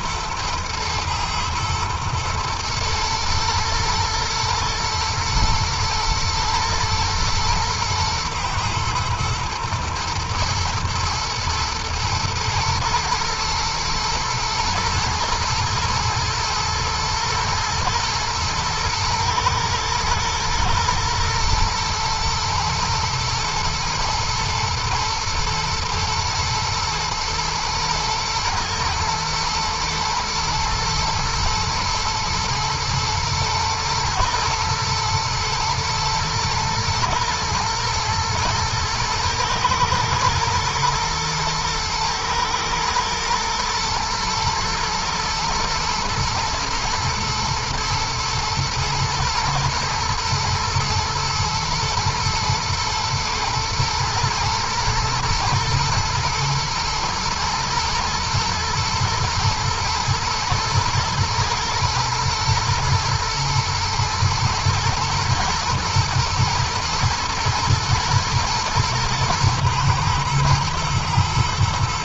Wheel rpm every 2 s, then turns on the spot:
110, 110, 120, 110, 110, 110, 120, 120, 120, 110, 110, 120, 120, 120, 120, 120, 110, 110, 110, 120, 120, 110, 120, 120, 120, 120, 110, 110, 120, 120, 110, 110, 110, 110, 110, 110.
none